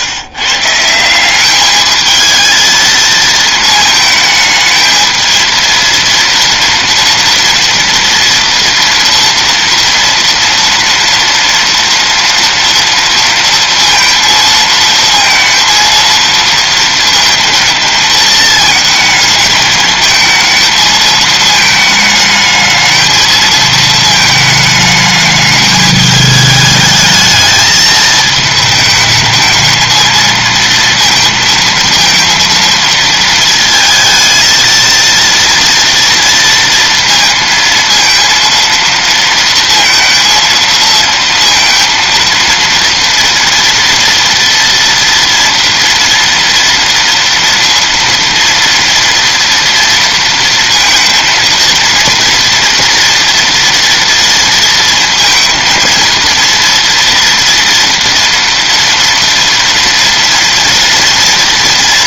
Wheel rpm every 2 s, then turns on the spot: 150, 230, 220, 230, 230, 230, 230, 230, 230, 220, 220, 220, 220, 220, 220, 230, 230, 230, 230, 230, 230, 230, 230, 230, 230, 230, 230, 230, 230, 230, 230.
none